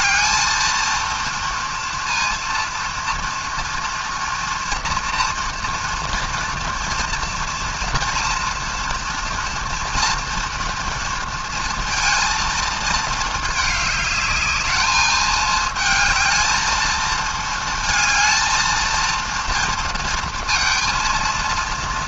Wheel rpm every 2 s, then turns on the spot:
230, 230, 230, 230, 240, 230, 230, 210, 220, 220, 230.
none